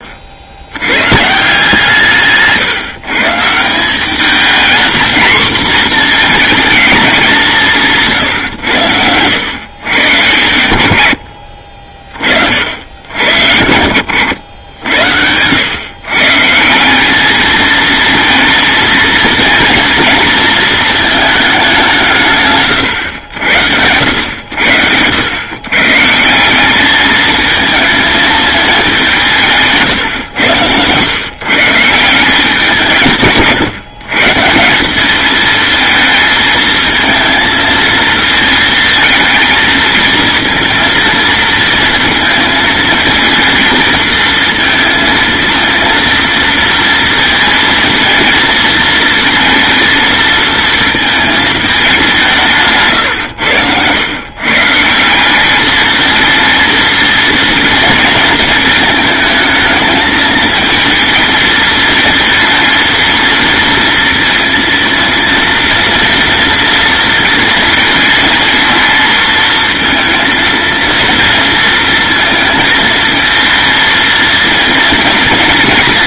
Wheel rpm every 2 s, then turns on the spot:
120, 150, 230, 200, 90, 80, 70, 80, 180, 230, 220, 120, 90, 210, 190, 110, 160, 190, 220, 230, 230, 220, 230, 230, 230, 230, 130, 170, 230, 220, 230, 230, 230, 230, 230, 230, 220, 230.
none